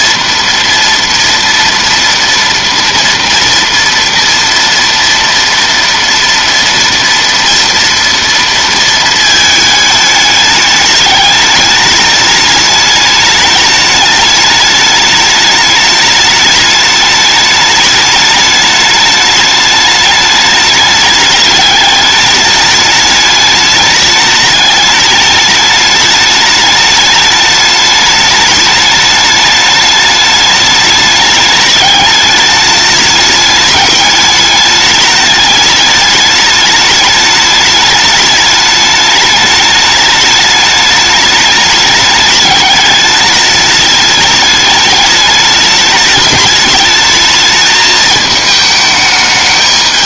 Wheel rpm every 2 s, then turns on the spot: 230, 230, 230, 230, 230, 210, 210, 210, 210, 210, 210, 210, 210, 210, 210, 210, 210, 210, 210, 210, 210, 210, 210, 220, 210.
none